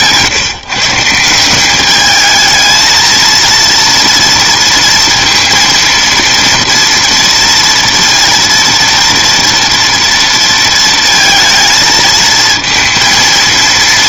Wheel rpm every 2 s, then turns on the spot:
150, 220, 230, 230, 230, 230, 230.
none